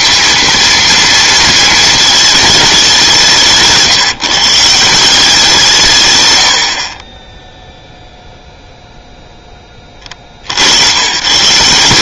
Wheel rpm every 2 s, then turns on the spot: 230, 200, 170, 70, 0, 80.
none